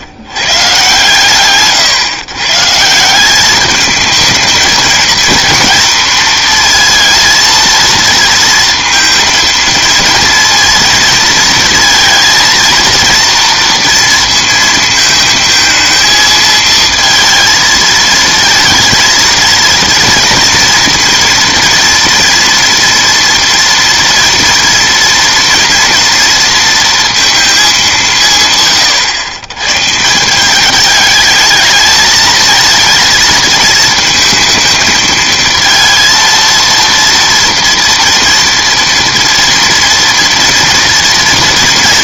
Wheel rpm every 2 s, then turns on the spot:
120, 140, 220, 230, 230, 230, 230, 230, 220, 230, 230, 230, 230, 230, 140, 190, 230, 220, 230, 230, 230.
none